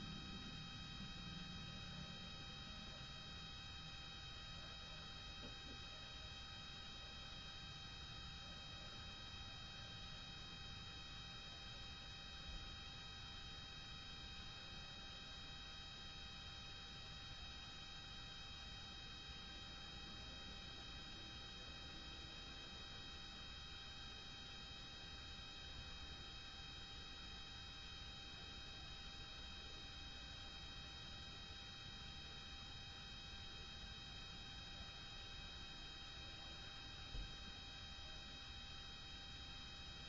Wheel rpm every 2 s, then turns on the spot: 0, 0, 0, 0, 0, 0, 0, 0, 0, 0, 0, 0, 0, 0, 0, 0, 0, 0, 0, 0.
none